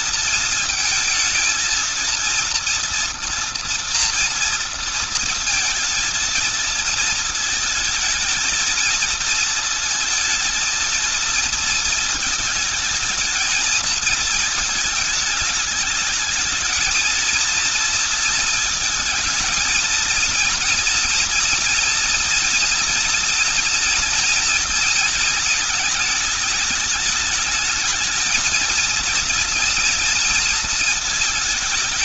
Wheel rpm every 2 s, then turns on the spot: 220, 230, 230, 220, 220, 230, 220, 220, 220, 220, 230, 230, 230, 220, 230, 220.
none